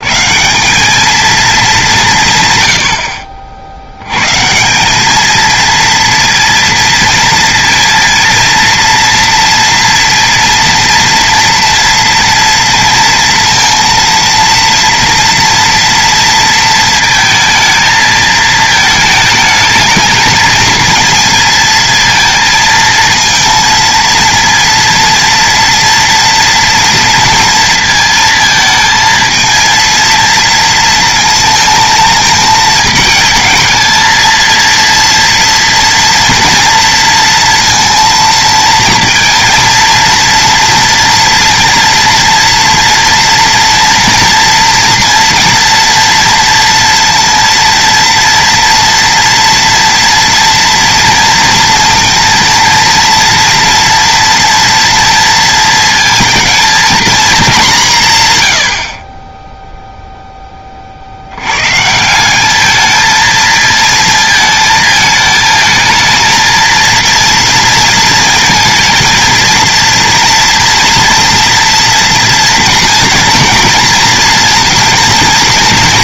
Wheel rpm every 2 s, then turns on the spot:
140, 160, 120, 230, 230, 230, 230, 230, 230, 220, 220, 230, 230, 230, 220, 230, 220, 230, 230, 230, 230, 240, 230, 230, 230, 230, 240, 230, 230, 130, 10, 180, 220, 220, 230, 230, 230, 230.
none